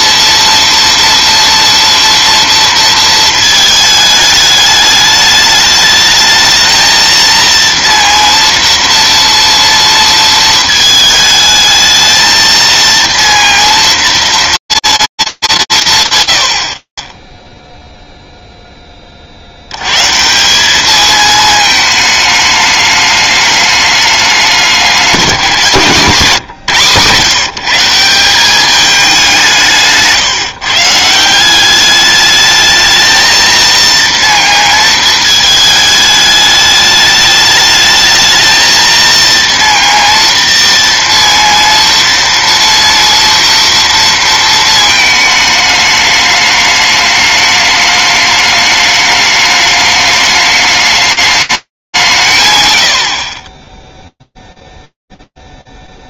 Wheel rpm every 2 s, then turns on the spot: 230, 230, 210, 220, 230, 220, 230, 230, 90, 0, 180, 210, 190, 160, 200, 140, 210, 230, 210, 220, 230, 230, 230, 210, 210, 210, 170, 0.
none